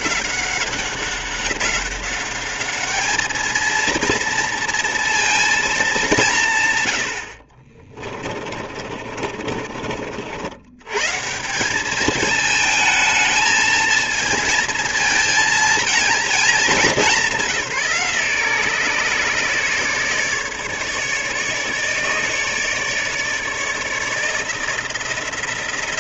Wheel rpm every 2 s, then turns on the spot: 190, 210, 230, 110, 40, 100, 220, 230, 200, 150, 150, 150, 170.
8-10